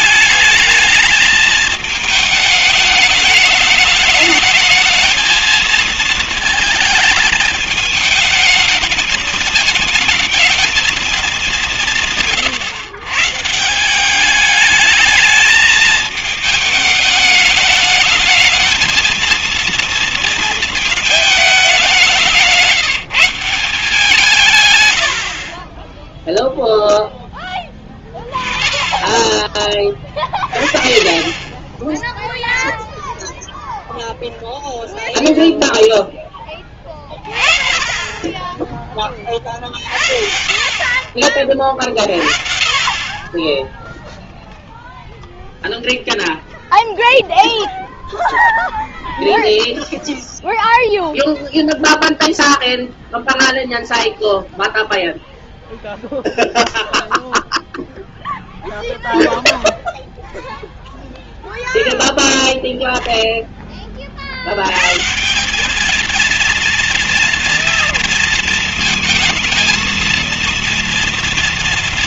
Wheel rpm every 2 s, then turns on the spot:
210, 210, 220, 220, 210, 220, 130, 210, 210, 230, 220, 170, 110, 0, 10, 30, 0, 0, 10, 30, 50, 30, 0, 0, 0, 0, 0, 0, 0, 0, 0, 0, 120, 230, 230, 230.
none